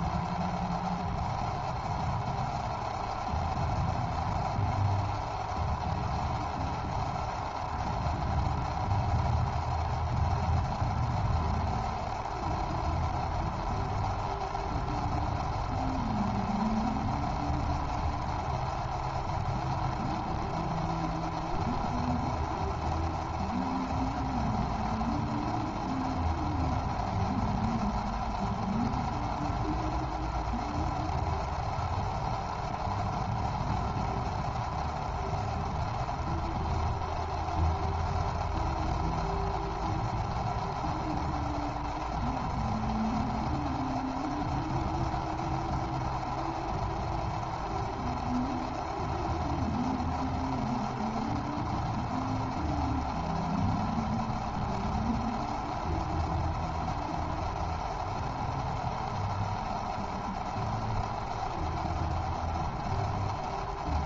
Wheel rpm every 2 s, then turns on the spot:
0, 0, 0, 0, 0, 0, 0, 0, 0, 0, 0, 0, 0, 0, 0, 0, 0, 0, 0, 0, 0, 0, 0, 0, 0, 0, 0, 0, 0, 0, 0, 0.
none